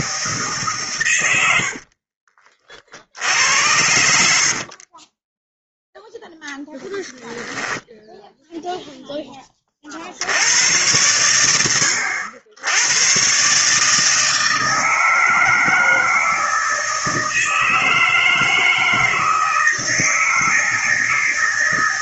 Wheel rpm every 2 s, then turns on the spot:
130, 50, 40, 10, 0, 100, 90, 160, 160, 160, 160.
none